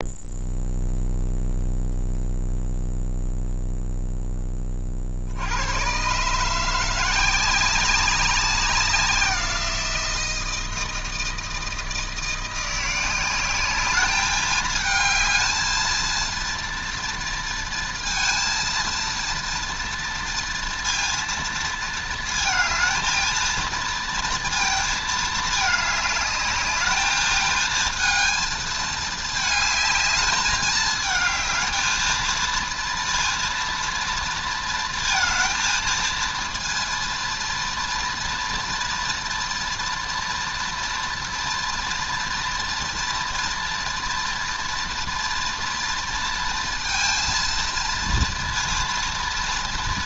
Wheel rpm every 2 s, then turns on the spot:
0, 0, 30, 170, 190, 160, 180, 220, 230, 230, 230, 220, 230, 210, 220, 220, 230, 230, 230, 230, 240, 230, 230, 230, 230.
none